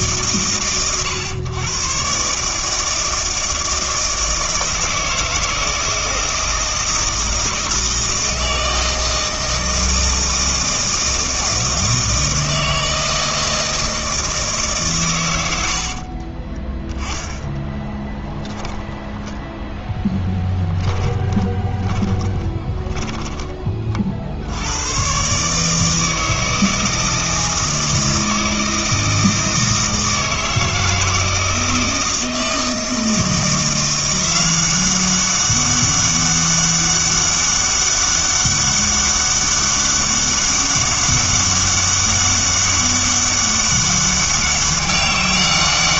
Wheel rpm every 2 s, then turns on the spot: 100, 150, 160, 160, 160, 160, 160, 150, 20, 10, 10, 10, 90, 160, 160, 160, 160, 190, 200, 200, 200, 200, 200.
16-18 20-24